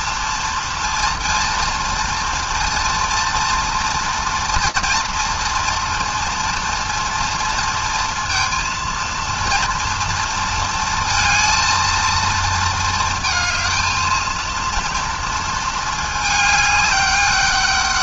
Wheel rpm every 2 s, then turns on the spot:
230, 230, 230, 230, 230, 230, 220, 230, 210.
none